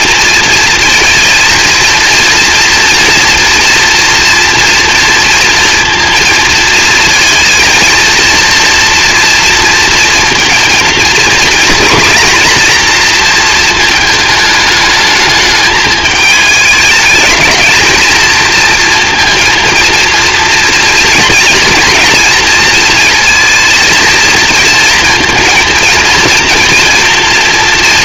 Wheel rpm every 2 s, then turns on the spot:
230, 230, 230, 230, 230, 230, 240, 220, 210, 230, 240, 230, 230, 230.
none